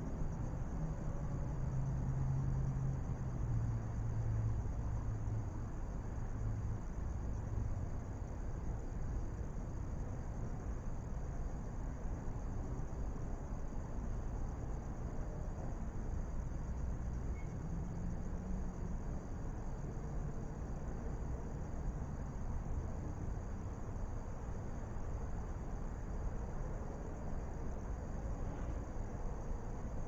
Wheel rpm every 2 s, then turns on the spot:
0, 0, 0, 0, 0, 0, 0, 0, 0, 0, 0, 0, 0, 0, 0.
none